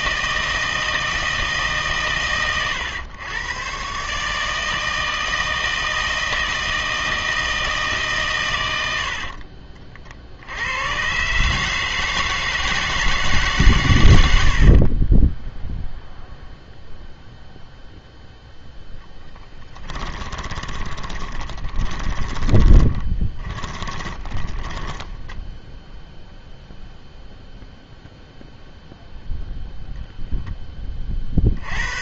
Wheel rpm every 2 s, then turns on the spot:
160, 110, 160, 160, 90, 90, 160, 60, 0, 0, 20, 20, 10, 0, 0, 10.
14-16 20-26